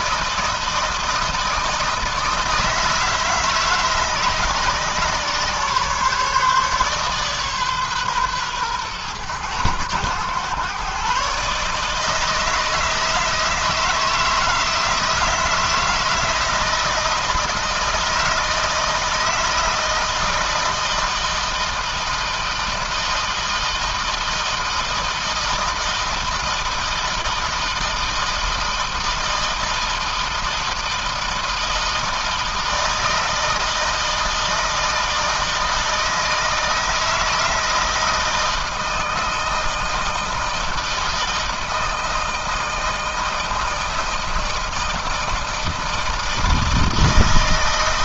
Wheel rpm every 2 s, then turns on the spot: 160, 160, 140, 140, 120, 120, 160, 160, 160, 160, 160, 160, 160, 160, 160, 160, 160, 160, 160, 160, 160, 160, 160, 160.
none